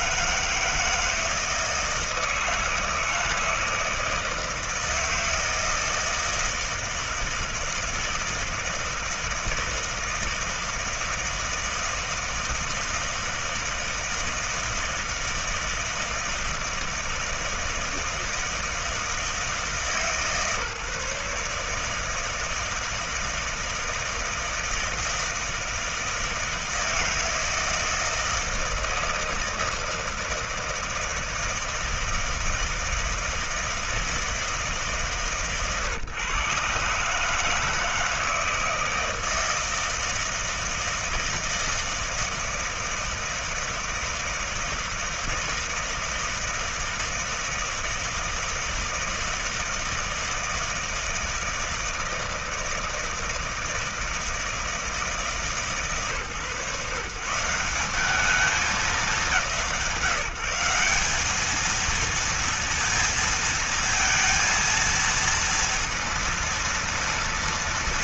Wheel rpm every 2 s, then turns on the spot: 160, 160, 160, 160, 160, 160, 160, 160, 160, 160, 150, 160, 160, 160, 160, 160, 160, 150, 140, 160, 160, 160, 160, 160, 160, 160, 160, 160, 150, 190, 190, 230, 230, 230.
none